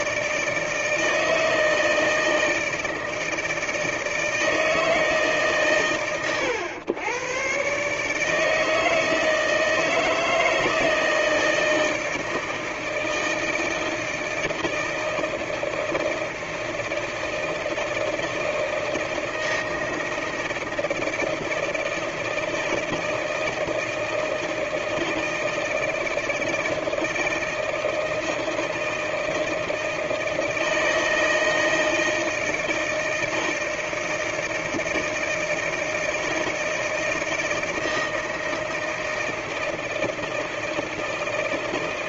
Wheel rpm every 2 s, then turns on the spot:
160, 160, 160, 90, 160, 160, 160, 160, 160, 160, 160, 160, 160, 160, 160, 160, 160, 160, 160, 160, 160.
none